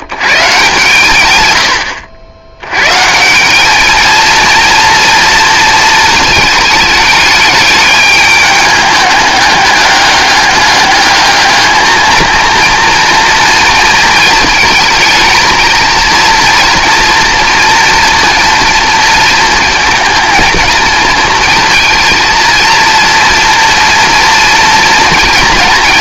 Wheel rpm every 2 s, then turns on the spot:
140, 100, 230, 220, 210, 210, 230, 220, 240, 240, 220, 230, 230.
none